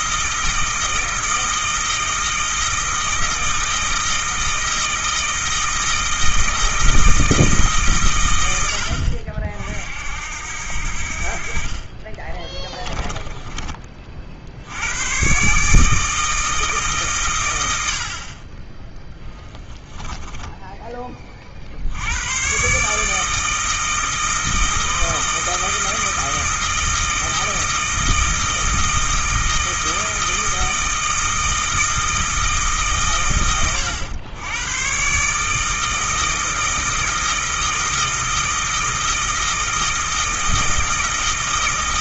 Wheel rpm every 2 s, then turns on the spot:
160, 160, 160, 160, 80, 70, 20, 90, 150, 20, 20, 140, 160, 160, 160, 160, 140, 120, 160, 160, 160.
12-14 18-22